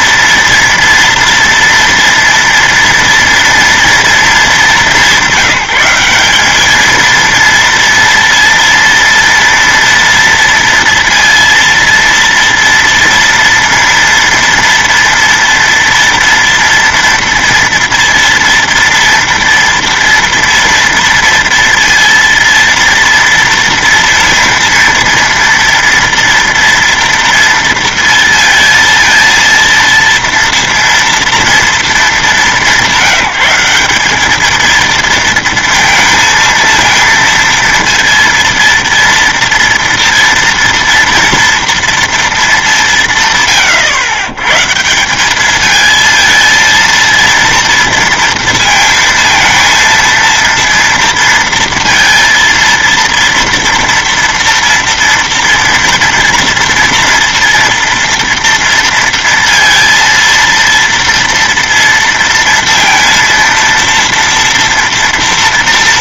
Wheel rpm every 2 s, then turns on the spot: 230, 230, 210, 210, 230, 230, 230, 230, 230, 230, 230, 230, 230, 230, 230, 230, 200, 220, 230, 230, 230, 180, 130, 230, 230, 230, 230, 230, 230, 230, 230, 230, 230.
none